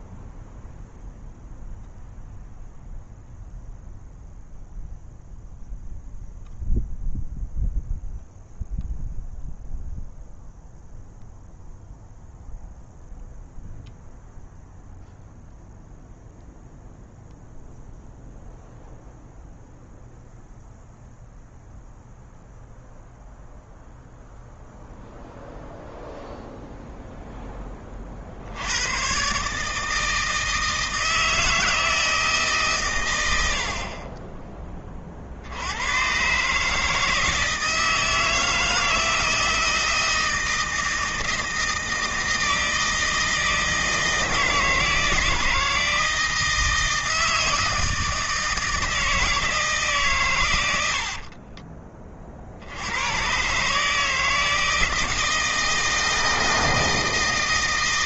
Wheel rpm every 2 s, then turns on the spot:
0, 0, 0, 0, 0, 0, 0, 0, 0, 0, 0, 0, 0, 0, 110, 160, 120, 30, 160, 160, 160, 160, 160, 160, 160, 80, 90, 160, 160.
50-52